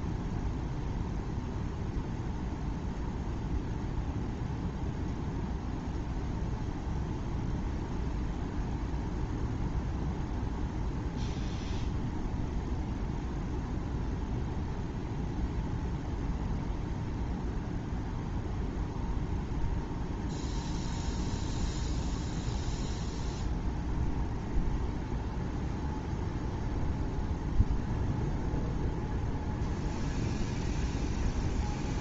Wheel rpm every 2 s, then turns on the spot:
0, 0, 0, 0, 0, 0, 0, 0, 0, 0, 0, 0, 0, 0, 0, 0.
none